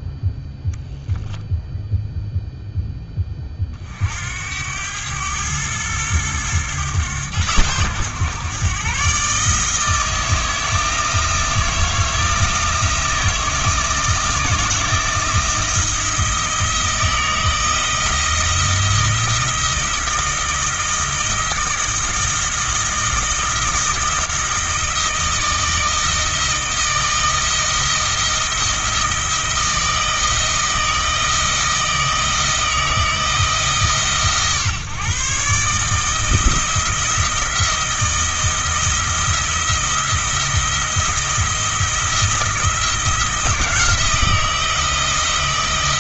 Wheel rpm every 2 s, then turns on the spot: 0, 10, 90, 110, 140, 160, 160, 160, 160, 170, 160, 160, 160, 160, 170, 160, 160, 140, 160, 170, 170, 170, 170.
none